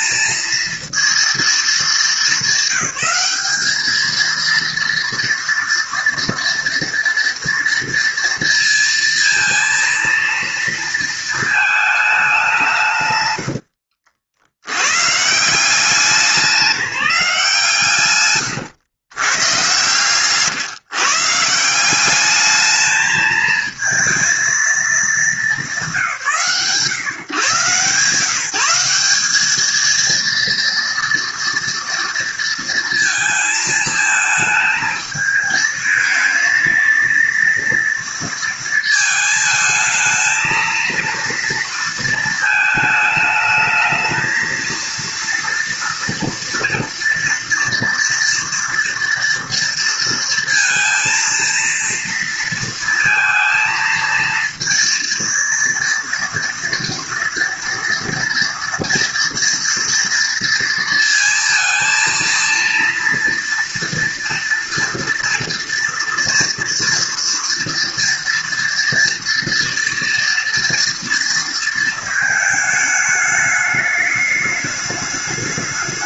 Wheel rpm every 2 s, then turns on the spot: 230, 200, 230, 230, 230, 230, 180, 80, 200, 120, 140, 210, 230, 150, 150, 230, 230, 220, 230, 230, 230, 220, 220, 230, 230, 230, 230, 230, 230, 230, 230, 230, 230, 230, 230, 230, 220, 210.
none